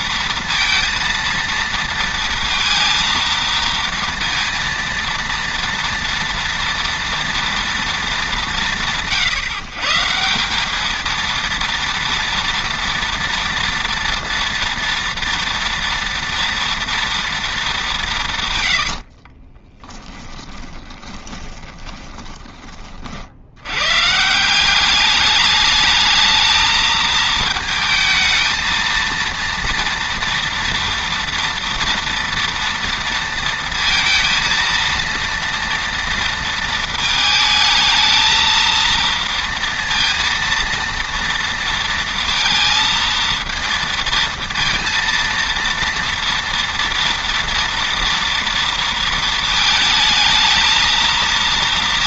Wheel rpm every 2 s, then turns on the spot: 230, 230, 230, 230, 170, 200, 230, 230, 230, 110, 20, 30, 190, 220, 230, 230, 240, 230, 230, 220, 230, 230, 230, 230, 230, 220.
18-22